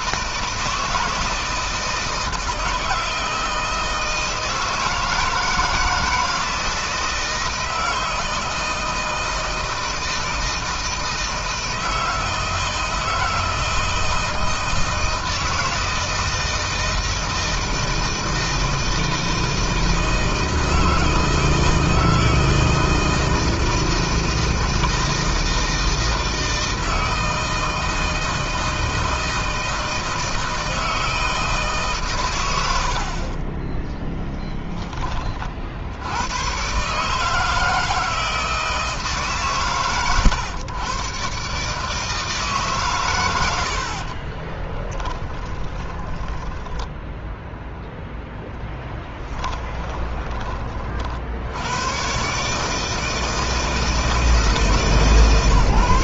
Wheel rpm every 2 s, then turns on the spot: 160, 170, 160, 160, 160, 160, 160, 160, 160, 160, 160, 160, 160, 160, 160, 160, 90, 10, 120, 160, 120, 140, 20, 10, 0, 30, 150, 160.
44-48